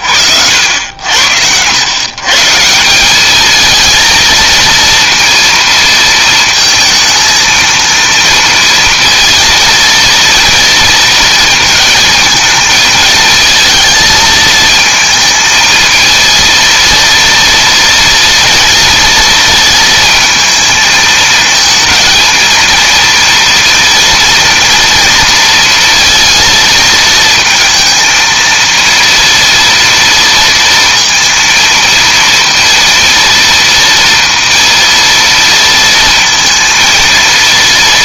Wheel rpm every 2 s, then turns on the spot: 90, 170, 230, 230, 230, 230, 220, 220, 230, 230, 220, 230, 230, 230, 230, 230, 230, 230, 230.
none